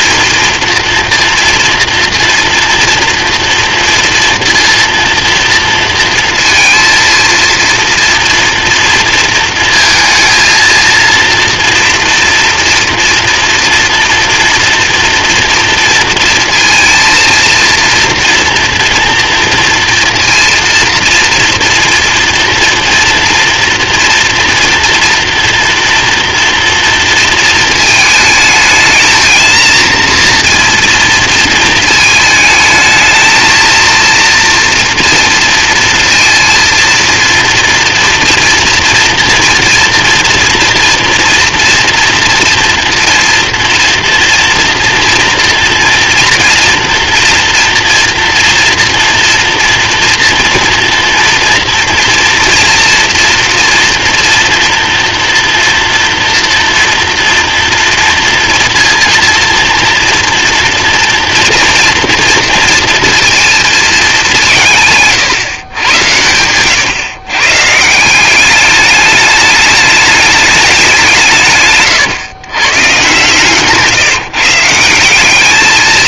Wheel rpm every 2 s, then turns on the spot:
230, 230, 230, 230, 230, 230, 230, 230, 230, 230, 230, 230, 230, 230, 220, 230, 220, 230, 230, 230, 240, 230, 230, 230, 230, 230, 240, 230, 240, 230, 230, 230, 170, 110, 200, 210, 120, 150.
none